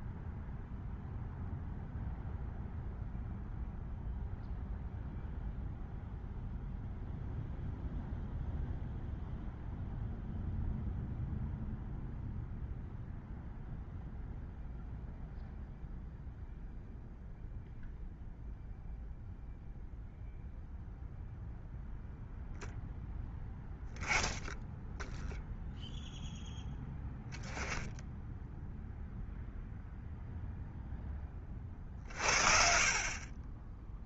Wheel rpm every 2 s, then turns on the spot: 0, 0, 0, 0, 0, 0, 0, 0, 0, 0, 0, 10, 10, 0, 0, 0, 40.
none